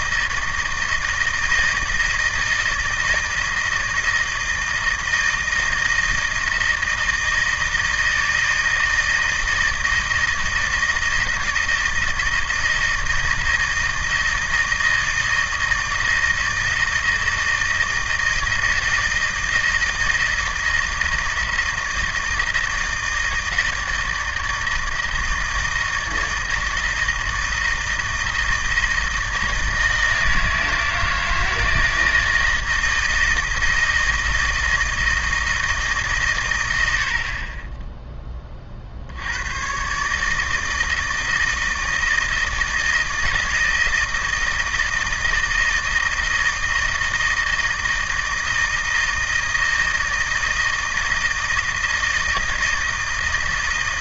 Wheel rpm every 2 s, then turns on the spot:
160, 160, 160, 160, 160, 160, 160, 160, 160, 160, 160, 160, 160, 160, 160, 160, 160, 160, 100, 40, 160, 160, 160, 160, 160, 160, 160.
none